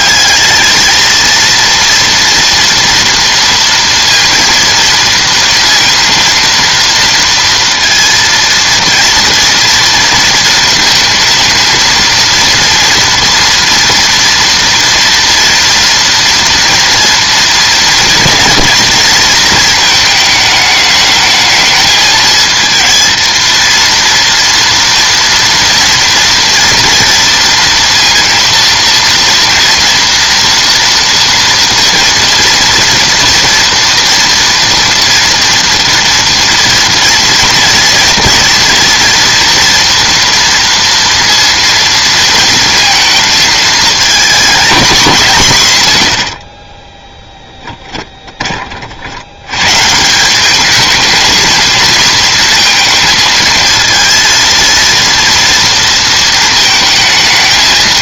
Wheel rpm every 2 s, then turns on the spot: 210, 230, 230, 230, 230, 230, 230, 230, 240, 230, 210, 230, 230, 230, 230, 240, 240, 230, 230, 230, 230, 230, 230, 40, 30, 200, 230, 230, 220.
46-48